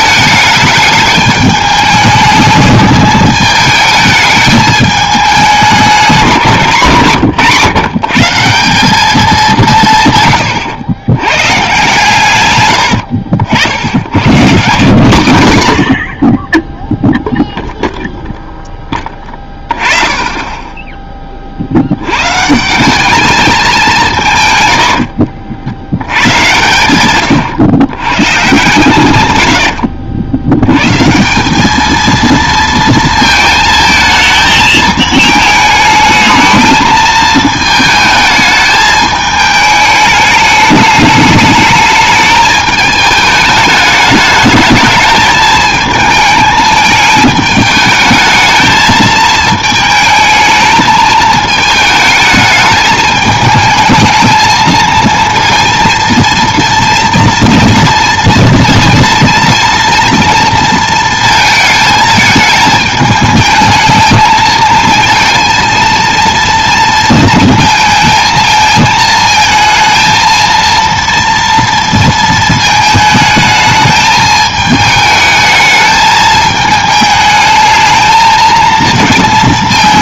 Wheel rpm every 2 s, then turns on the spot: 210, 210, 210, 150, 190, 100, 100, 150, 10, 10, 20, 160, 110, 120, 140, 110, 230, 220, 220, 220, 210, 220, 210, 220, 220, 220, 220, 220, 230, 230, 230, 220, 230, 230, 220, 230, 220, 220, 220, 230.
12-14